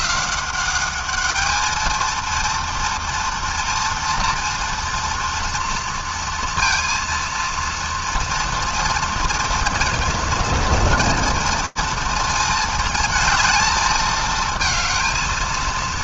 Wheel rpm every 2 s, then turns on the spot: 190, 230, 230, 230, 230, 230, 230, 230.
none